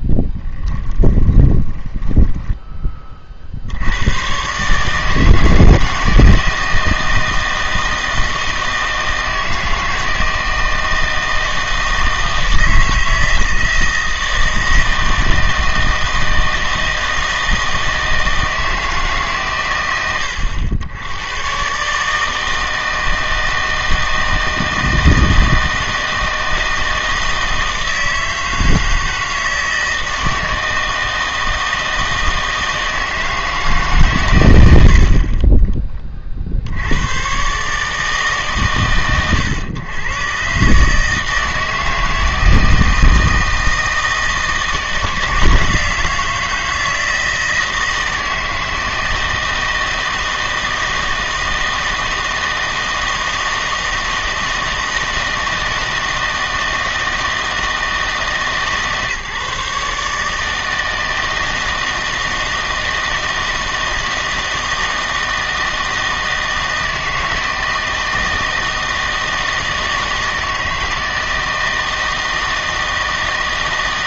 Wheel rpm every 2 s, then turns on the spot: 10, 10, 140, 160, 160, 160, 160, 160, 160, 160, 90, 160, 160, 160, 160, 160, 160, 80, 70, 120, 140, 160, 160, 160, 160, 160, 160, 160, 160, 150, 160, 160, 160, 160, 160, 160, 160.
0-2